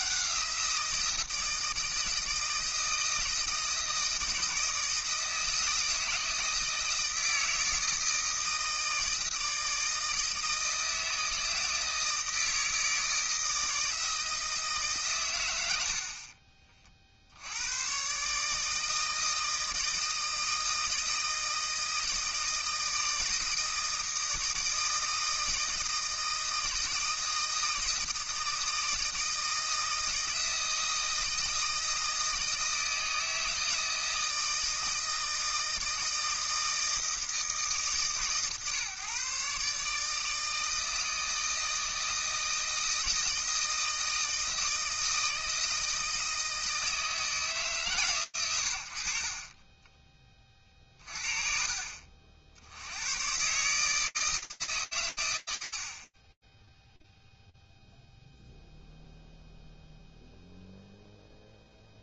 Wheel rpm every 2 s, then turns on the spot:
180, 160, 160, 160, 160, 160, 160, 160, 30, 150, 160, 160, 160, 160, 160, 160, 160, 160, 160, 140, 160, 160, 160, 160, 80, 30, 70, 150, 10, 0, 0.
none